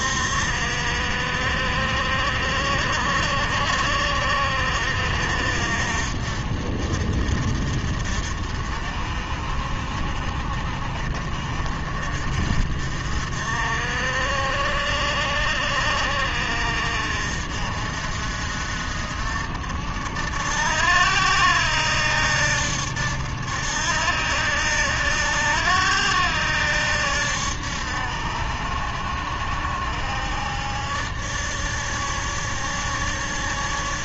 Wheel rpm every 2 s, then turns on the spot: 60, 60, 60, 50, 50, 50, 50, 60, 60, 60, 70, 80, 70, 70, 70, 70, 70.
none